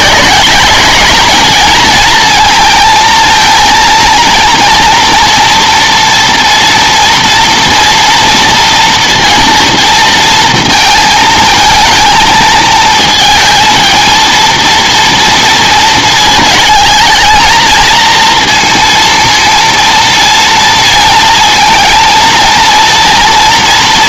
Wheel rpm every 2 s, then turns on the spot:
200, 220, 230, 230, 230, 230, 220, 230, 220, 230, 230, 230.
none